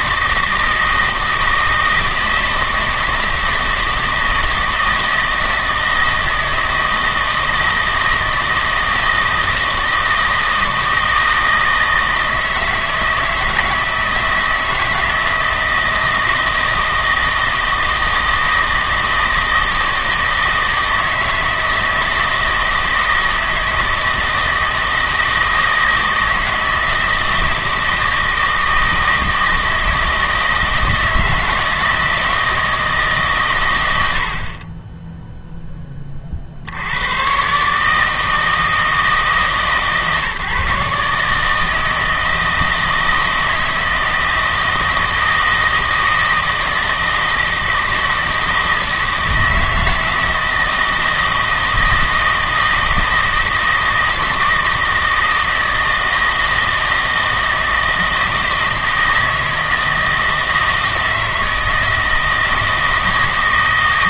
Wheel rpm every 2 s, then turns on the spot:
160, 160, 160, 160, 160, 160, 160, 160, 160, 160, 160, 160, 160, 160, 160, 160, 160, 30, 70, 160, 150, 160, 160, 160, 160, 160, 160, 160, 160, 160, 160, 160.
none